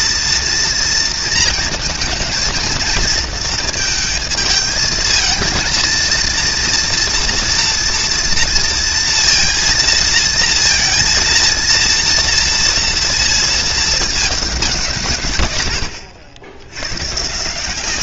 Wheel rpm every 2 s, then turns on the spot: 230, 230, 220, 230, 230, 230, 230, 200, 80.
none